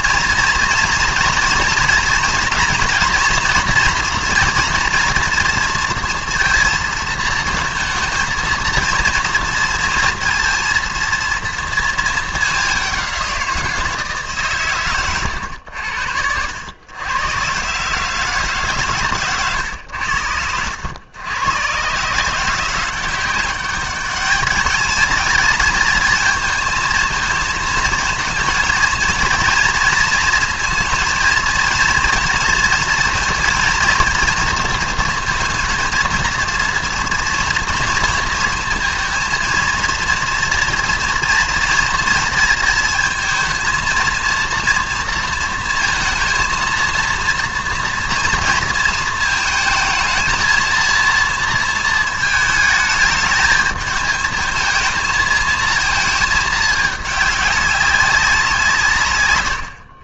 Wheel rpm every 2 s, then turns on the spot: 230, 230, 230, 230, 230, 230, 210, 140, 90, 140, 80, 170, 210, 220, 230, 230, 230, 230, 230, 230, 230, 230, 230, 230, 230, 230, 220, 220, 220, 170.
none